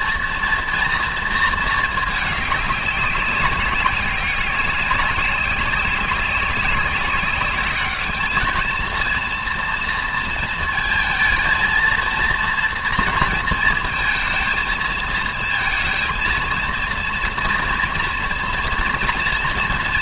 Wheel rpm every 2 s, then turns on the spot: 230, 210, 200, 190, 220, 230, 230, 230, 230, 230.
none